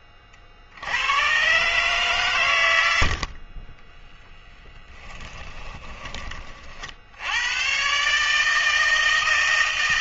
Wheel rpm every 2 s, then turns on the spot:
50, 110, 10, 40, 160.
none